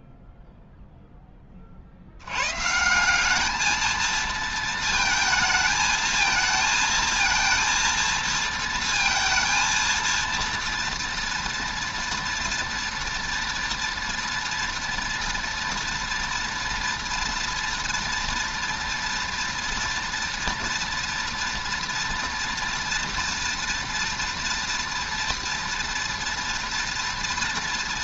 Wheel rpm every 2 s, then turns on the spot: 0, 140, 230, 220, 230, 230, 240, 230, 230, 230, 240, 230, 230, 230.
none